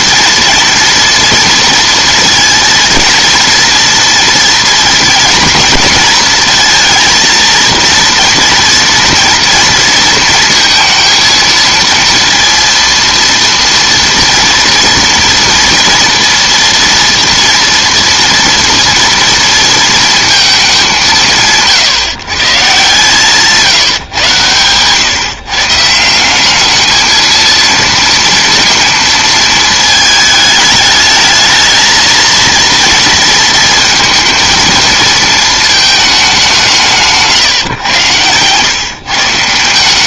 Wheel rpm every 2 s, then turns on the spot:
230, 230, 230, 230, 230, 230, 230, 240, 240, 230, 210, 140, 120, 200, 230, 220, 230, 220, 190, 120.
none